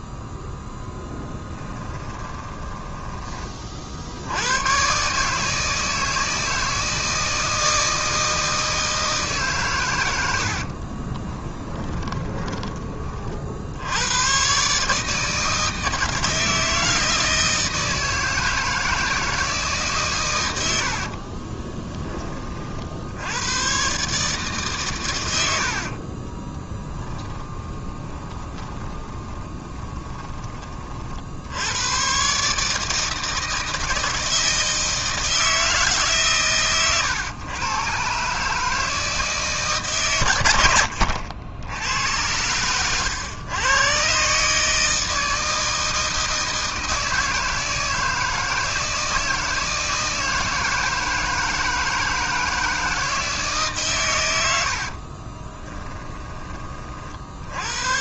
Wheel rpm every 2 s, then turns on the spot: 0, 20, 120, 160, 160, 60, 30, 130, 160, 160, 90, 40, 140, 10, 20, 30, 150, 160, 130, 150, 100, 100, 150, 160, 160, 160, 160, 80, 30.
2-4 10-14 26-30 54-56